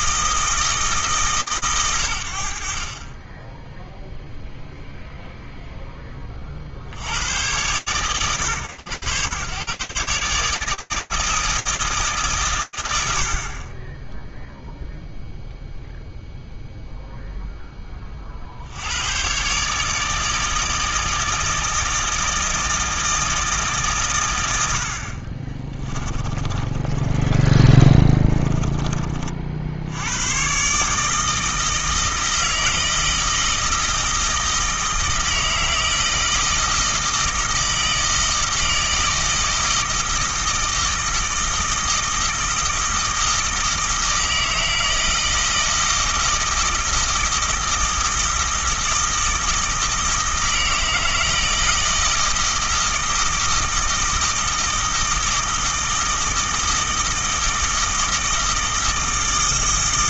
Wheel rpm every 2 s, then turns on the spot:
150, 10, 0, 90, 120, 160, 60, 0, 20, 150, 160, 140, 30, 30, 70, 160, 160, 160, 160, 160, 160, 160, 160, 160, 160, 160, 160, 160, 160, 160.
24-28